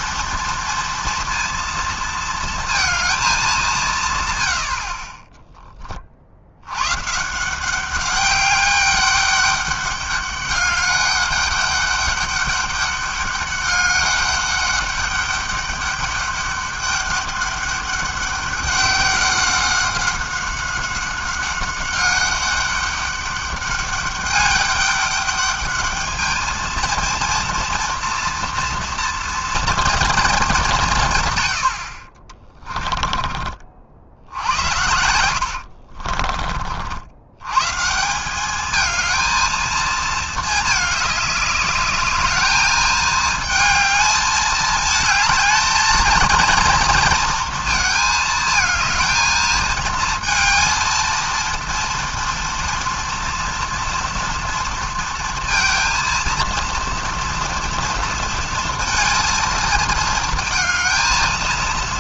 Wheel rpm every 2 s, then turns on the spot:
230, 230, 70, 100, 200, 200, 200, 200, 200, 190, 190, 200, 200, 230, 230, 180, 30, 70, 60, 220, 210, 210, 220, 230, 220, 230, 230, 230, 230, 230, 220.
32-34